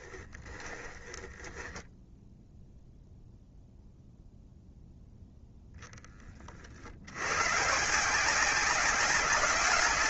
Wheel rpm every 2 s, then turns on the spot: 10, 0, 0, 60, 190.
0-2